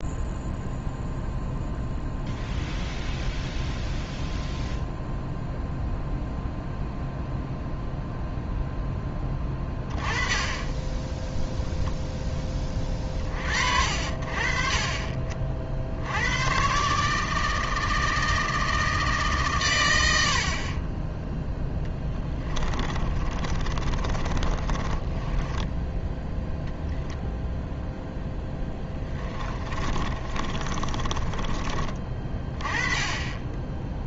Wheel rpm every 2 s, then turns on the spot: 0, 0, 0, 0, 0, 10, 30, 40, 130, 160, 40, 20, 20, 0, 10, 30, 20.
22-26 28-32